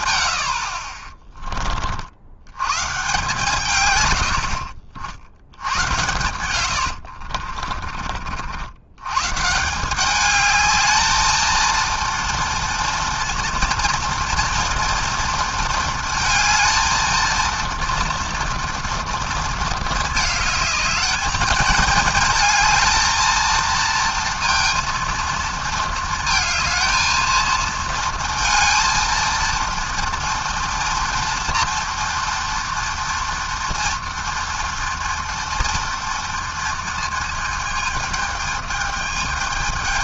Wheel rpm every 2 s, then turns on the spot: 30, 140, 80, 50, 140, 220, 230, 230, 220, 230, 220, 230, 230, 230, 230, 230, 230, 230, 220, 220.
6-8